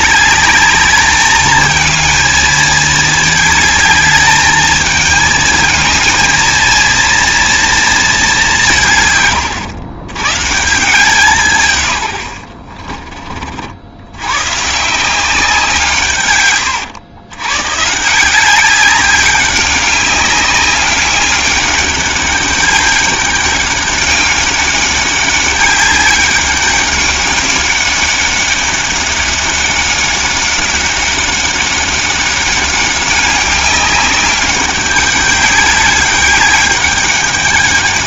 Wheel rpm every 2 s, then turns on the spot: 210, 220, 220, 230, 180, 150, 60, 140, 120, 190, 200, 200, 200, 200, 200, 190, 200, 200, 200.
12-14